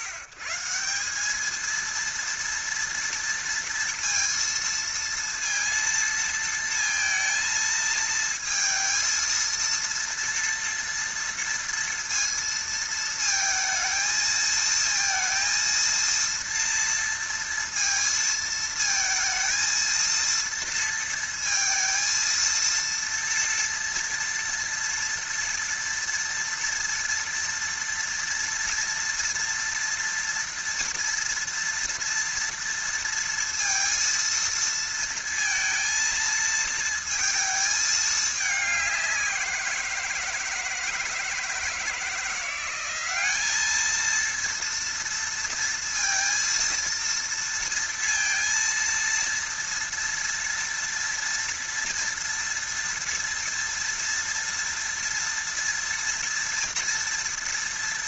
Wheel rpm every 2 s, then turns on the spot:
130, 230, 230, 230, 230, 230, 230, 220, 230, 220, 230, 230, 230, 230, 230, 230, 230, 230, 220, 200, 160, 180, 230, 230, 230, 230, 230, 230, 230.
none